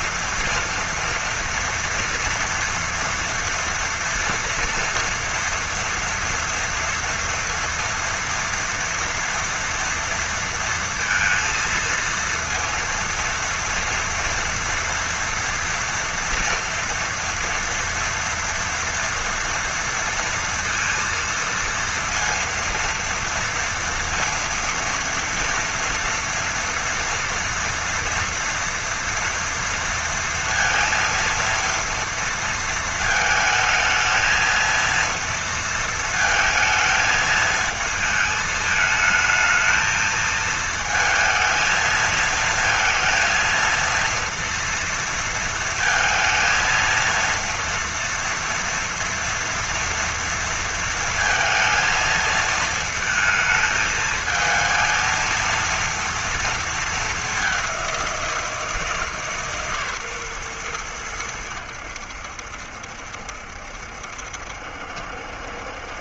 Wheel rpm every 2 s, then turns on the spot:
230, 230, 230, 230, 230, 230, 230, 230, 230, 230, 230, 230, 230, 240, 230, 230, 230, 230, 220, 220, 220, 230, 230, 230, 230, 230, 220, 220, 230, 170, 120, 70, 70.
none